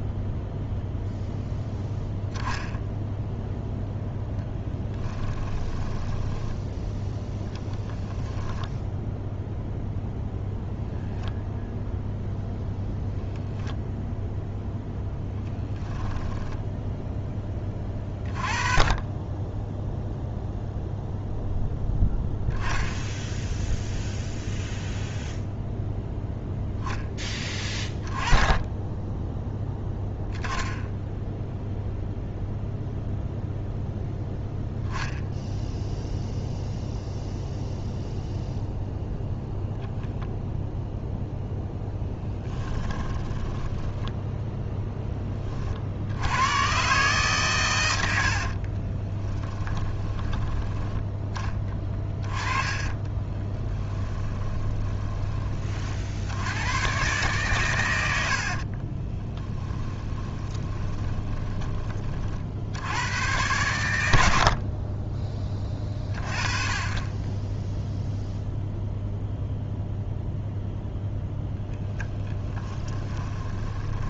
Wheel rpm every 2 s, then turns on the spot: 0, 0, 20, 10, 0, 0, 0, 0, 0, 20, 0, 0, 0, 10, 10, 10, 0, 0, 0, 0, 0, 10, 0, 130, 30, 20, 20, 20, 110, 30, 20, 80, 20, 20, 0, 0, 10.
4-6 42-44 48-50 52-56 58-62 72-74